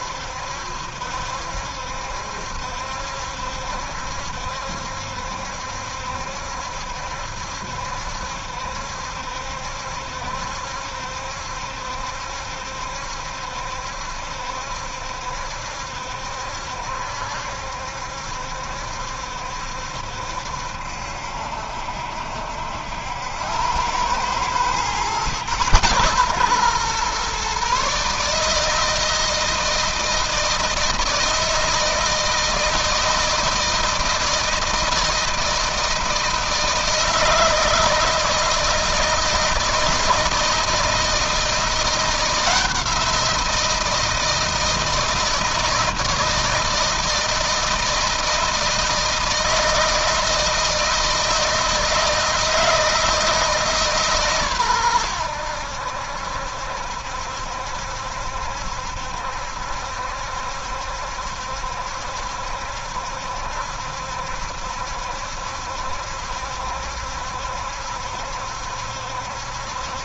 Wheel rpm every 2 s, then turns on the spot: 70, 70, 70, 70, 70, 70, 70, 70, 70, 70, 70, 80, 120, 130, 160, 160, 160, 160, 160, 160, 160, 170, 160, 160, 160, 160, 160, 120, 70, 70, 70, 70, 70, 70, 70.
none